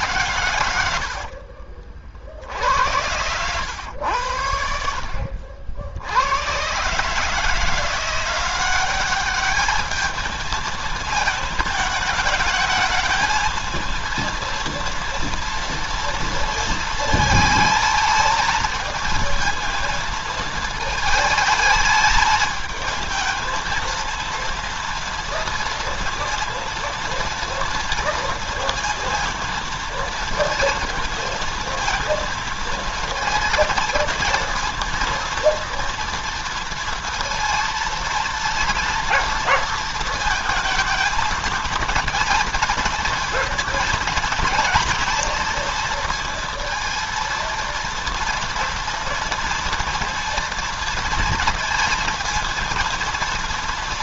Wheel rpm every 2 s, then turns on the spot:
110, 70, 80, 110, 180, 220, 210, 230, 230, 230, 220, 220, 230, 230, 230, 230, 230, 230, 230, 230, 220, 220, 230, 230, 230, 230, 230.
0-2